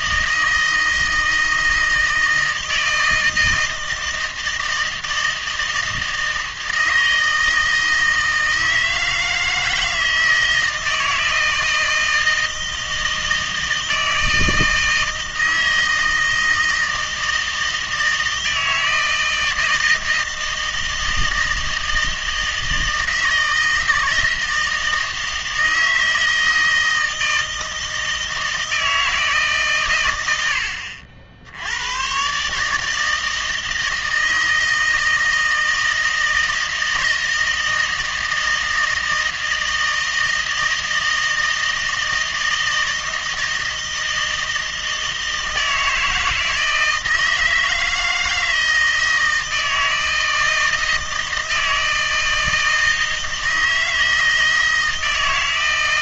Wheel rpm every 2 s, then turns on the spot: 160, 160, 160, 160, 160, 160, 160, 160, 160, 160, 160, 160, 160, 160, 160, 80, 150, 160, 160, 160, 160, 160, 160, 160, 160, 160, 160, 160.
none